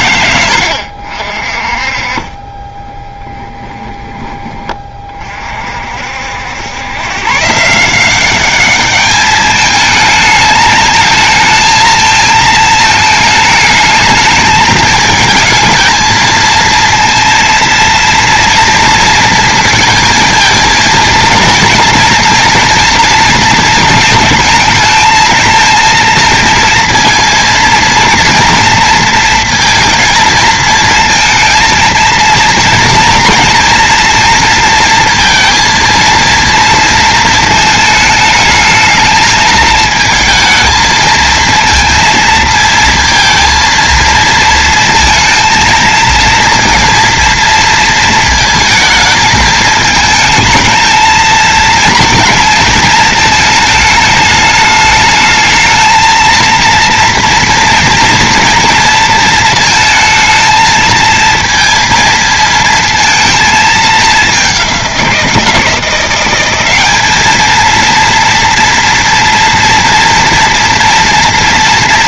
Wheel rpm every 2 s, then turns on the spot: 90, 10, 30, 100, 210, 220, 220, 220, 230, 230, 230, 230, 220, 230, 230, 220, 230, 230, 230, 210, 220, 230, 230, 230, 220, 220, 220, 210, 230, 230, 230, 230, 190, 200, 230, 230.
2-4